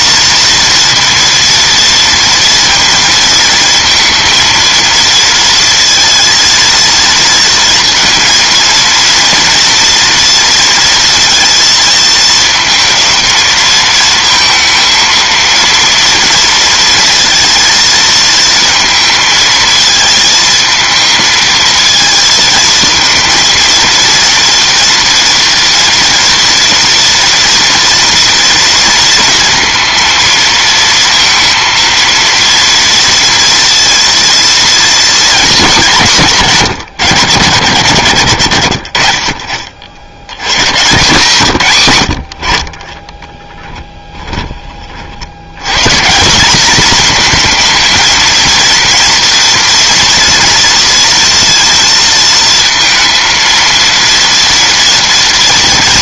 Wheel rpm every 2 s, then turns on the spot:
240, 230, 230, 230, 230, 230, 220, 230, 230, 220, 220, 230, 230, 230, 230, 230, 230, 230, 150, 90, 120, 40, 30, 210, 240, 230, 230, 230.
none